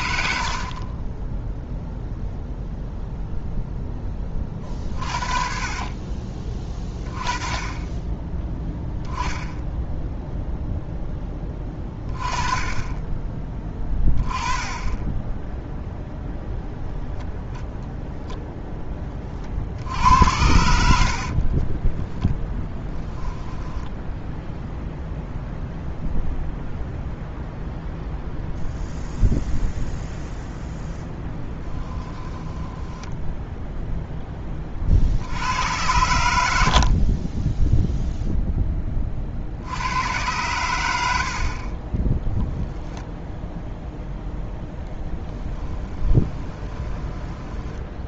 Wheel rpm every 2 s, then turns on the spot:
50, 0, 40, 20, 10, 0, 20, 10, 0, 10, 70, 10, 0, 0, 0, 0, 10, 40, 60, 20, 90, 0, 0, 20.
14-16 20-24 32-34 46-48